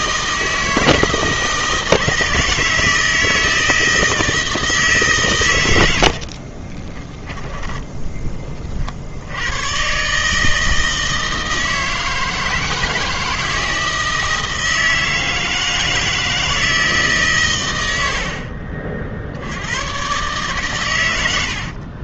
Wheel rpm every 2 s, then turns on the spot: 160, 160, 150, 20, 50, 160, 160, 160, 160, 50, 120.
6-8